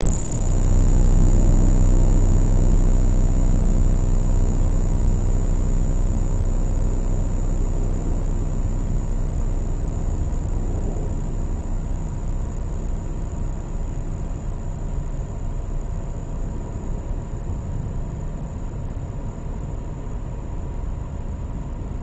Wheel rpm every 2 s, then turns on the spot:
0, 0, 0, 0, 0, 0, 0, 0, 0, 0, 0.
none